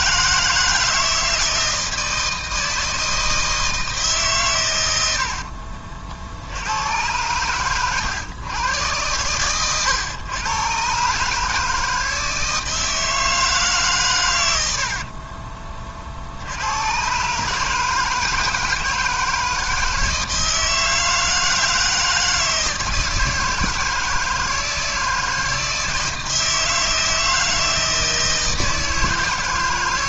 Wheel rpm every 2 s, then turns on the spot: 160, 160, 100, 100, 110, 130, 160, 60, 120, 160, 160, 160, 160, 160, 160.
14-16